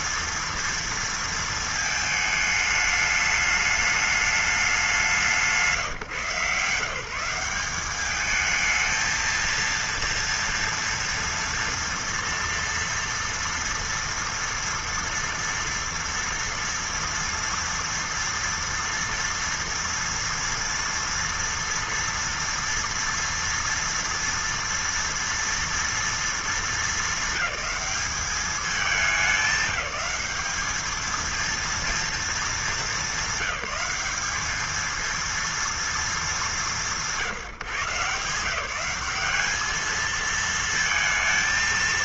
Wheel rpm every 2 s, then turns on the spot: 230, 220, 210, 160, 210, 230, 230, 230, 230, 230, 230, 230, 230, 230, 210, 210, 220, 210, 210, 160, 220.
none